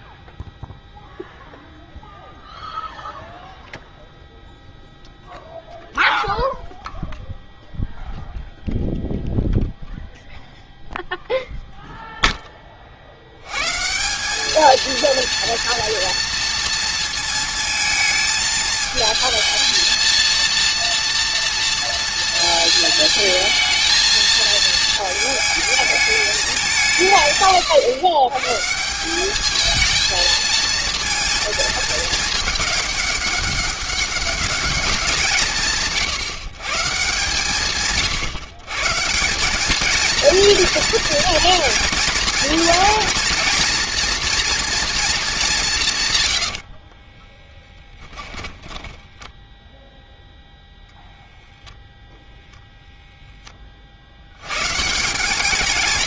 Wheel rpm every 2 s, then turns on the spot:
0, 0, 0, 0, 0, 0, 20, 210, 230, 220, 230, 230, 220, 190, 140, 230, 210, 210, 140, 130, 230, 230, 240, 70, 20, 0, 0, 120.
46-50